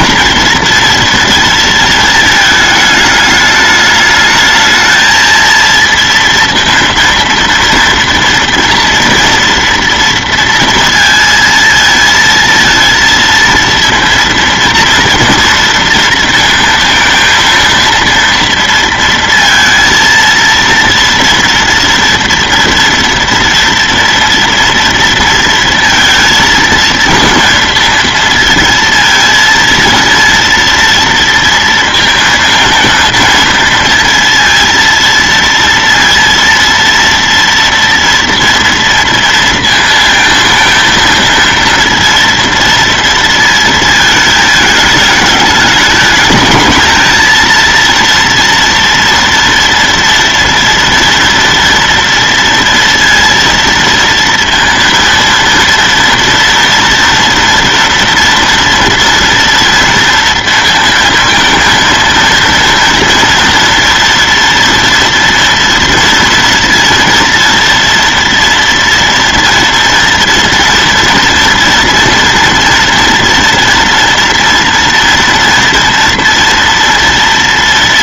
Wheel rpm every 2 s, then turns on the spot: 230, 210, 220, 230, 230, 230, 230, 230, 230, 230, 230, 230, 230, 220, 230, 230, 230, 230, 230, 230, 230, 230, 210, 220, 230, 230, 230, 230, 230, 230, 230, 230, 230, 230, 230, 230, 230, 240, 230.
none